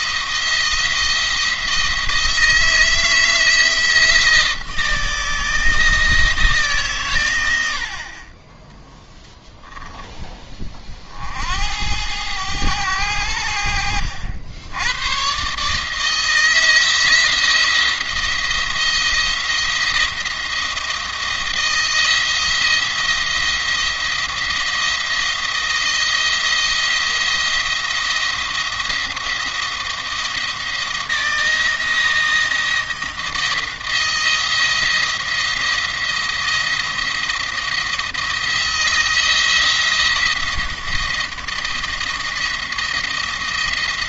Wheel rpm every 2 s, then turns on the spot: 170, 160, 160, 140, 10, 40, 90, 90, 160, 170, 170, 170, 170, 170, 170, 170, 170, 170, 170, 160, 170, 170.
none